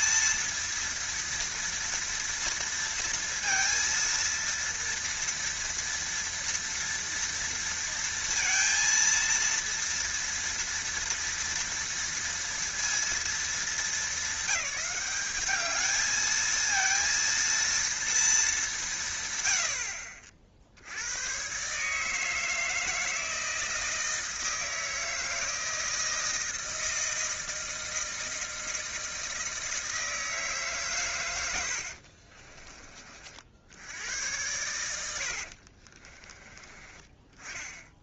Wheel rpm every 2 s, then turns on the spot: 230, 230, 230, 230, 230, 230, 230, 200, 230, 160, 90, 160, 160, 160, 160, 130, 40, 90, 20.
34-36